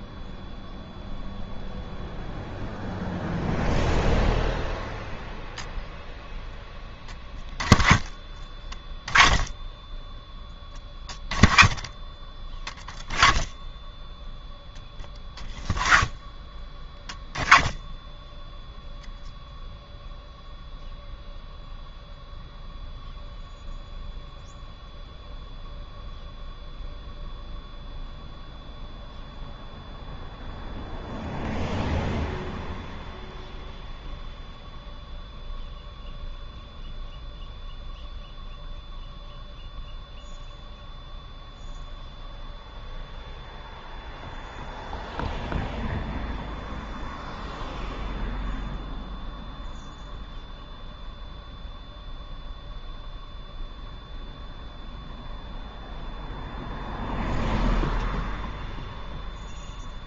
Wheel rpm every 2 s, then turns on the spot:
0, 0, 0, 20, 30, 20, 20, 20, 20, 0, 0, 0, 0, 0, 0, 0, 0, 0, 0, 0, 0, 0, 0, 0, 0, 0, 0, 0, 0, 0.
none